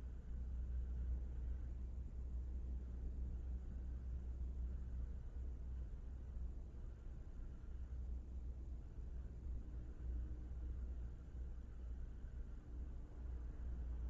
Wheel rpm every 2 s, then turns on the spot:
0, 0, 0, 0, 0, 0, 0.
none